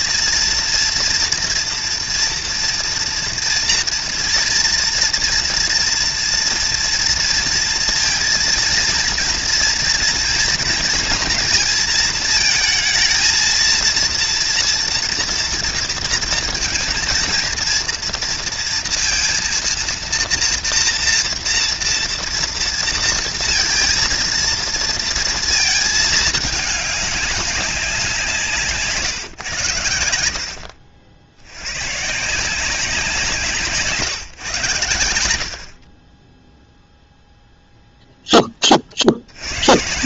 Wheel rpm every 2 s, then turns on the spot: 230, 230, 230, 230, 230, 230, 230, 230, 220, 230, 230, 230, 230, 200, 150, 60, 180, 100, 0, 60.
28-30